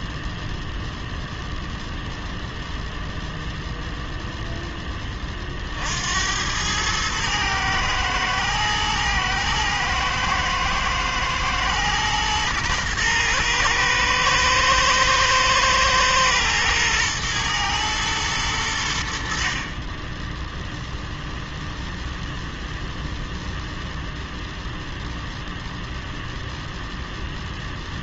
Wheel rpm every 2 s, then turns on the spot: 0, 0, 10, 110, 110, 110, 120, 120, 110, 90, 0, 0, 0, 0.
none